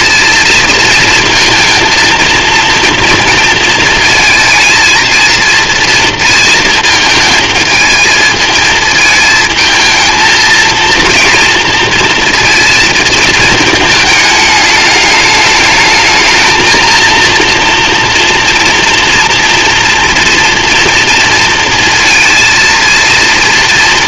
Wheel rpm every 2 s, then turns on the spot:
230, 230, 220, 220, 220, 230, 230, 210, 230, 230, 240, 230.
none